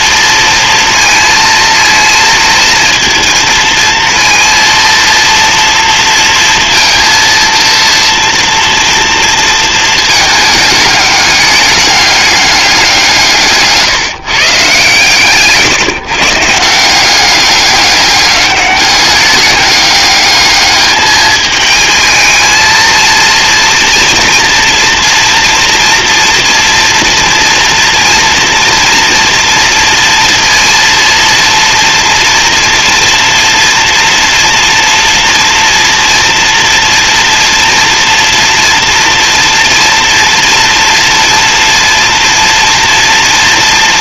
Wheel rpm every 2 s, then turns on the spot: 230, 230, 230, 230, 230, 210, 180, 140, 170, 200, 210, 230, 230, 230, 230, 230, 230, 230, 230, 230, 230, 230.
none